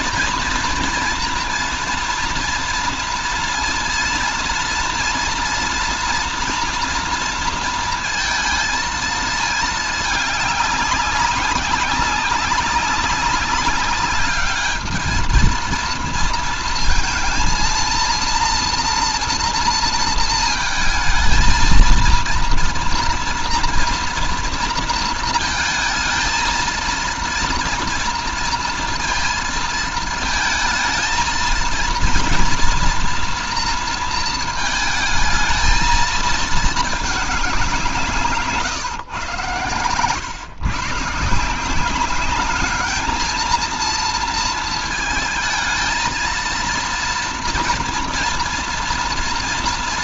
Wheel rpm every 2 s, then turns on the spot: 230, 230, 240, 240, 230, 200, 200, 210, 220, 230, 220, 230, 230, 230, 230, 220, 230, 220, 220, 140, 130, 210, 230, 230, 230.
none